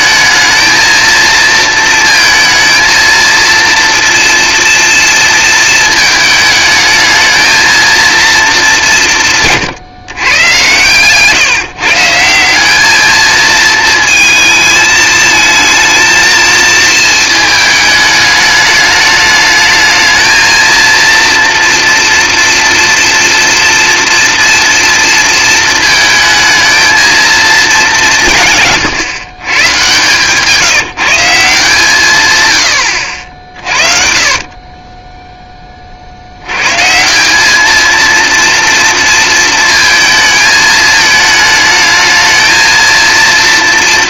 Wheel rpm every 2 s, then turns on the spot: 230, 230, 230, 220, 160, 140, 220, 220, 220, 210, 230, 230, 230, 220, 140, 170, 60, 10, 180, 230, 220, 230.
none